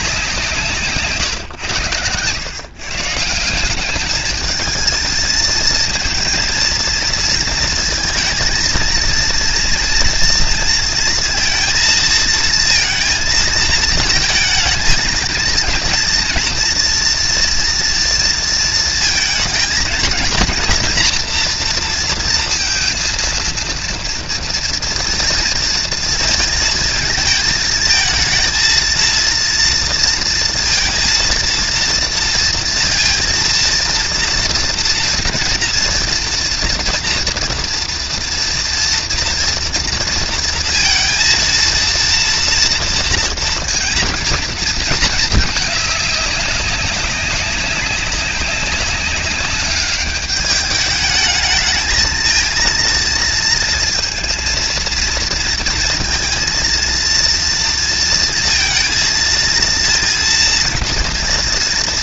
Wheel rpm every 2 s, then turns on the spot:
140, 140, 220, 230, 230, 230, 230, 220, 230, 230, 240, 230, 230, 220, 230, 230, 230, 240, 230, 240, 230, 230, 220, 200, 200, 210, 230, 230, 230, 230, 230.
none